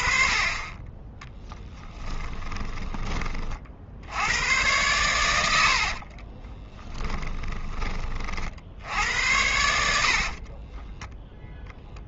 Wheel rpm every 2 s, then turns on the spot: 30, 20, 110, 30, 60, 40.
2-4 6-8 10-12